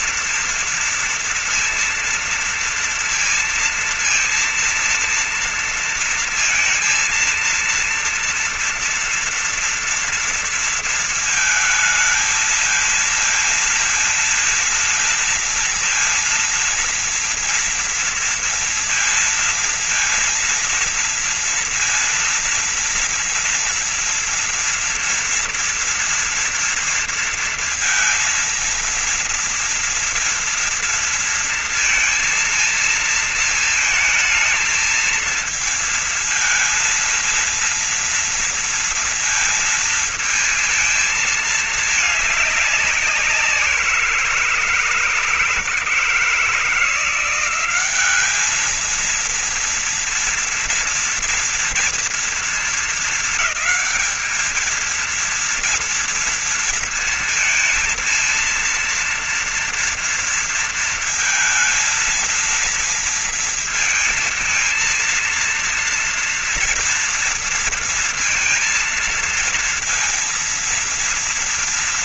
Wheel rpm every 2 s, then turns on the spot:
230, 230, 230, 230, 230, 230, 220, 230, 230, 230, 230, 230, 230, 230, 230, 230, 230, 220, 230, 230, 230, 210, 170, 160, 200, 230, 230, 220, 230, 230, 230, 230, 230, 230, 230, 230.
none